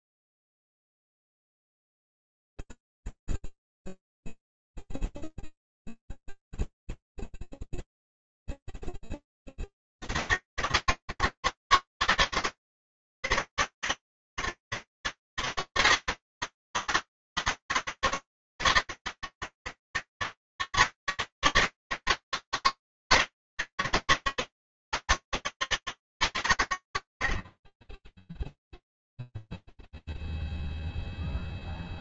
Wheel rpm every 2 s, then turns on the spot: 0, 0, 0, 0, 0, 70, 130, 130, 160, 120, 120, 130, 140, 100, 0, 0.
none